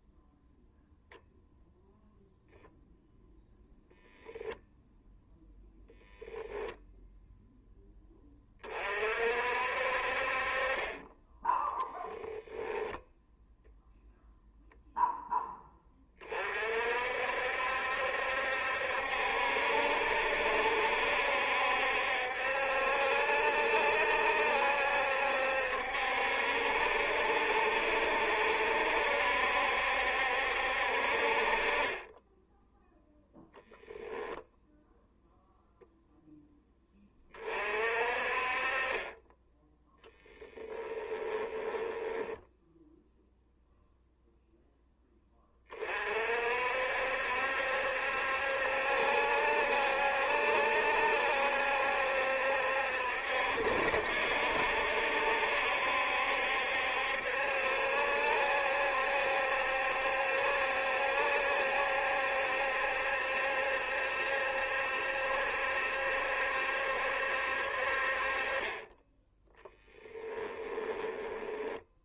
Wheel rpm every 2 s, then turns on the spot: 0, 0, 0, 0, 40, 30, 0, 0, 50, 70, 70, 70, 70, 70, 70, 60, 0, 0, 20, 30, 20, 0, 10, 60, 70, 70, 70, 70, 70, 70, 70, 70, 70, 70, 20, 10.
40-42 70-72